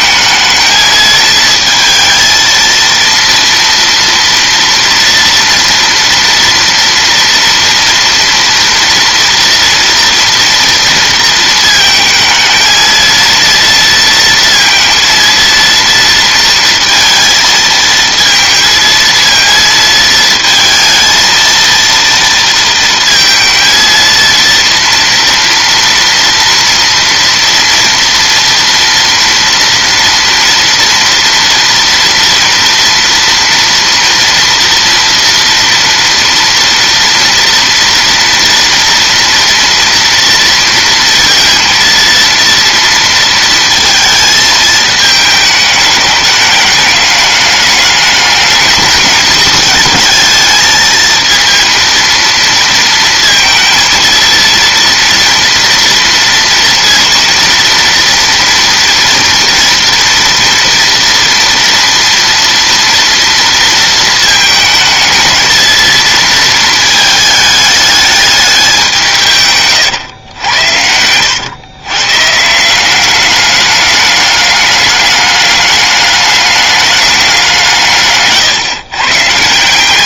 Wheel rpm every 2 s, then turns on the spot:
220, 230, 230, 230, 230, 230, 220, 230, 230, 230, 220, 230, 230, 230, 230, 230, 230, 230, 230, 230, 230, 230, 220, 210, 210, 220, 230, 230, 230, 230, 230, 240, 220, 220, 190, 100, 160, 210, 210, 140.
70-72